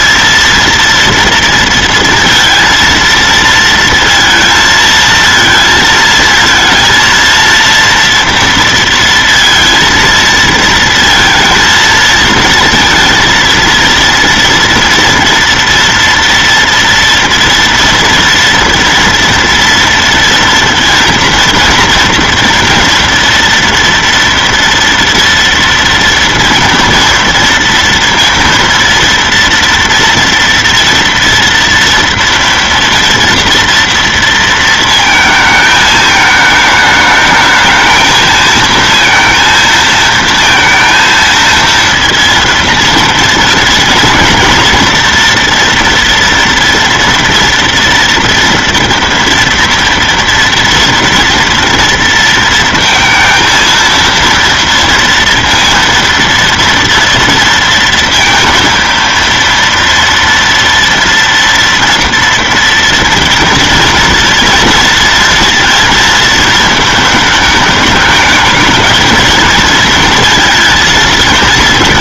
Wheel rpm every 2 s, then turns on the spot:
230, 230, 230, 230, 230, 230, 230, 230, 230, 230, 230, 240, 230, 230, 230, 240, 230, 230, 220, 220, 230, 230, 230, 230, 230, 230, 230, 230, 230, 230, 230, 240, 230, 220, 220, 220.
none